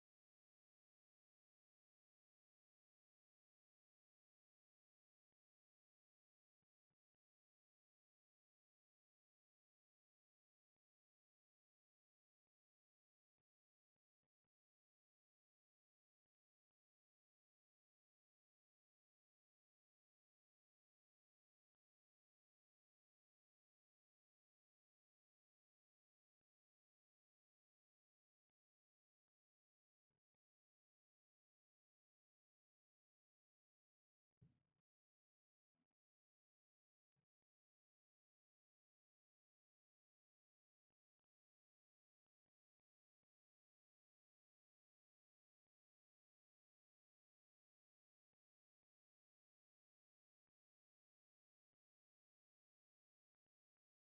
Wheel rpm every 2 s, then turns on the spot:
0, 0, 0, 0, 0, 0, 0, 0, 0, 0, 0, 0, 0, 0, 0, 0, 0, 0, 0, 0, 0, 0, 0, 0, 0, 0, 0.
none